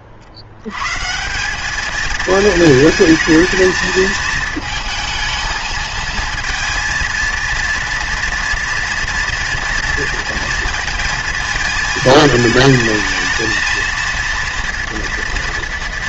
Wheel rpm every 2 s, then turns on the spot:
110, 220, 220, 230, 230, 230, 220, 240.
none